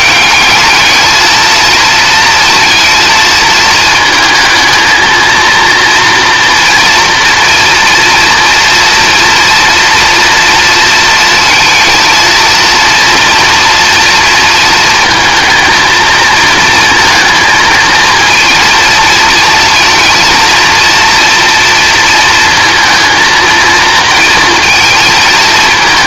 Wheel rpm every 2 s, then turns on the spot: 210, 230, 220, 230, 230, 230, 230, 230, 220, 230, 230, 220, 220.
none